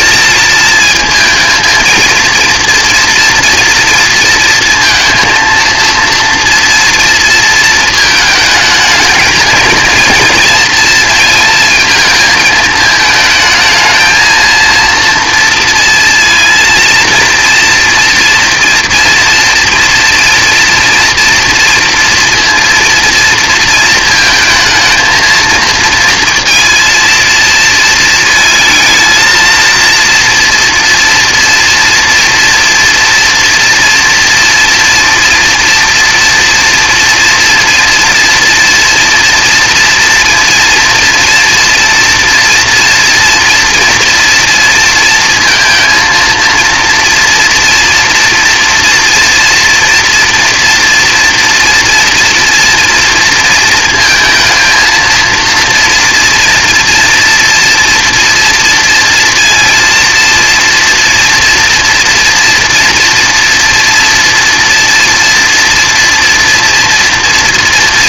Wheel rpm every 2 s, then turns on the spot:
220, 230, 230, 230, 220, 230, 220, 230, 230, 240, 230, 230, 220, 230, 220, 230, 230, 230, 230, 240, 240, 230, 230, 230, 230, 230, 230, 230, 230, 230, 230, 230, 230, 230.
none